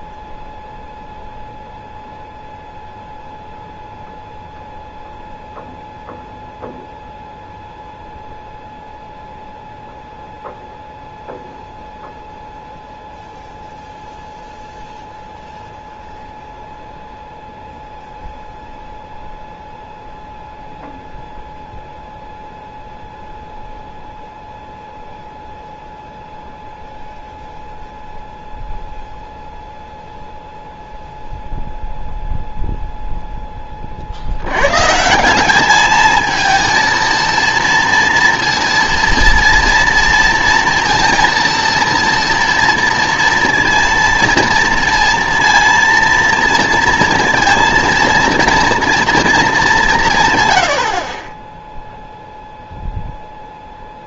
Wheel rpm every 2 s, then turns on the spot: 0, 0, 0, 0, 0, 0, 0, 0, 0, 0, 0, 0, 0, 0, 0, 0, 0, 110, 220, 230, 230, 230, 230, 230, 230, 100, 0.
none